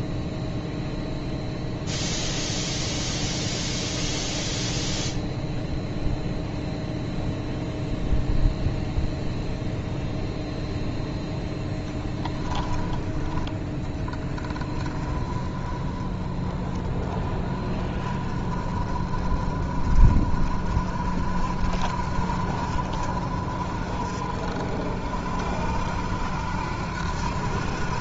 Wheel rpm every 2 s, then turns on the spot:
0, 0, 0, 0, 0, 0, 10, 20, 20, 30, 40, 50, 50, 70.
none